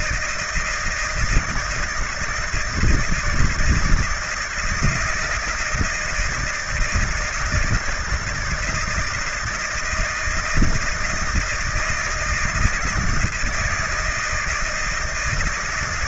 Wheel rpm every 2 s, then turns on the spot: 160, 160, 160, 160, 160, 170, 160, 160.
none